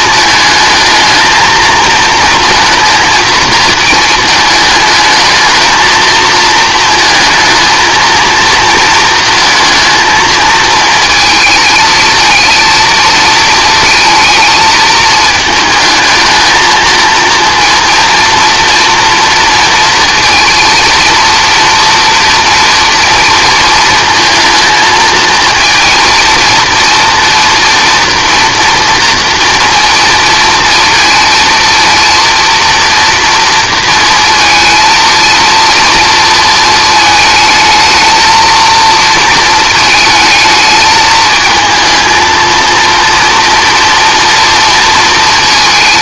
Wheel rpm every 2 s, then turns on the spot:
220, 230, 220, 230, 230, 220, 230, 220, 220, 230, 230, 230, 220, 230, 230, 230, 230, 230, 220, 230, 220, 230, 230.
none